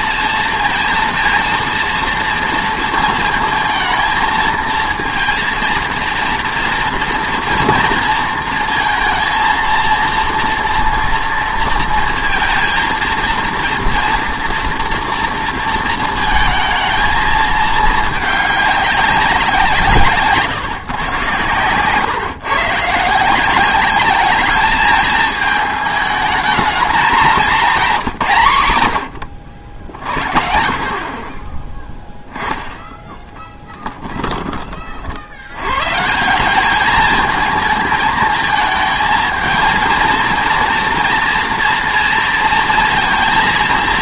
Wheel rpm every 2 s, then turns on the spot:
230, 230, 230, 230, 230, 230, 230, 230, 230, 200, 140, 140, 210, 220, 120, 70, 10, 30, 200, 220, 230, 230.
none